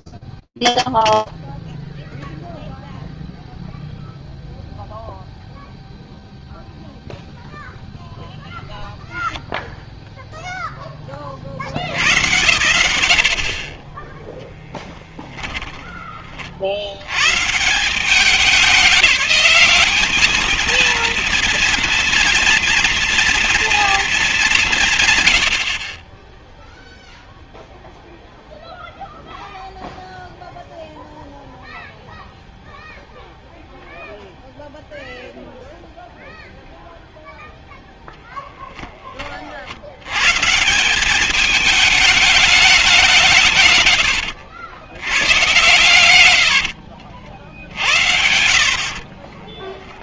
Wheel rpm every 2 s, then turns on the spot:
0, 0, 0, 0, 0, 40, 50, 20, 110, 200, 230, 240, 90, 0, 0, 0, 0, 0, 0, 40, 200, 170, 100, 50, 40.
14-16 24-26 48-50